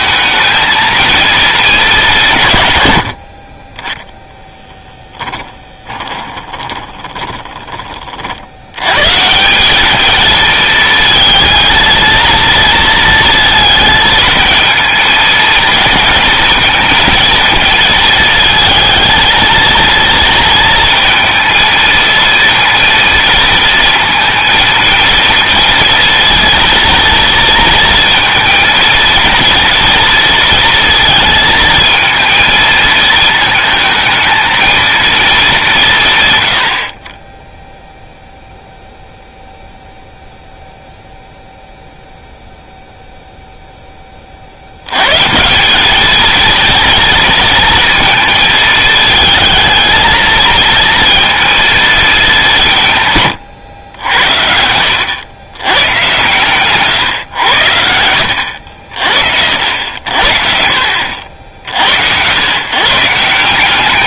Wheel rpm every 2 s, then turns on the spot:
220, 100, 10, 20, 110, 220, 230, 220, 230, 220, 230, 230, 230, 230, 230, 230, 220, 220, 70, 0, 0, 0, 80, 230, 220, 230, 160, 90, 130, 70, 60, 140.
4-8